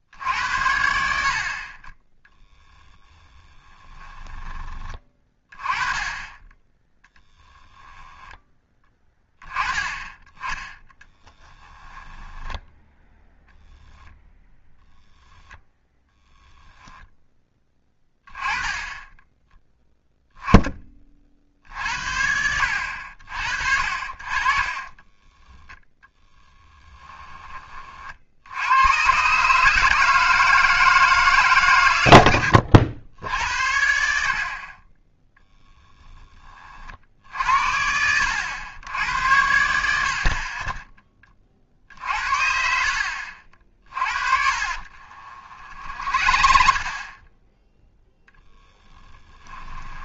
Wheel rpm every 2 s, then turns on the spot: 70, 10, 20, 20, 10, 10, 10, 10, 10, 20, 10, 70, 30, 10, 100, 160, 70, 40, 40, 90, 30, 70, 50, 40, 10.
2-4 14-16 24-28 44-46 48-50